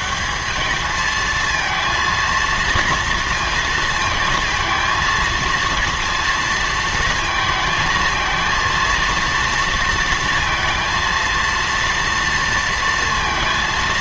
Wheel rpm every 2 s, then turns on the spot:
200, 230, 230, 230, 230, 230, 230.
none